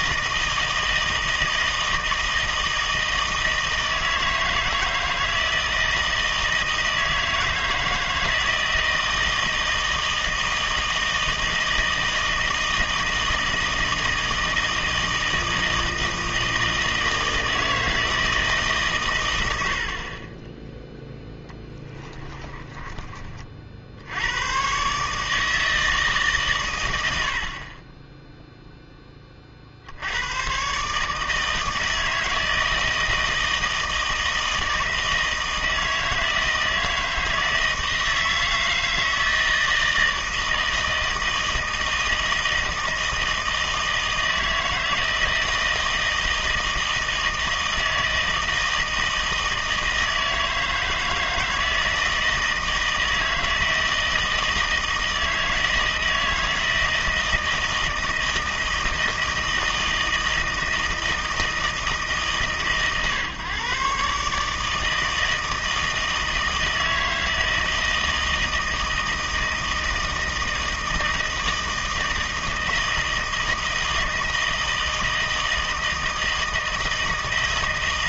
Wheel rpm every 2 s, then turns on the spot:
160, 160, 160, 160, 160, 160, 160, 160, 160, 140, 10, 30, 130, 120, 10, 140, 160, 160, 160, 160, 160, 160, 160, 160, 160, 160, 160, 160, 160, 160, 160, 130, 160, 160, 160, 160, 160, 160, 160.
22-24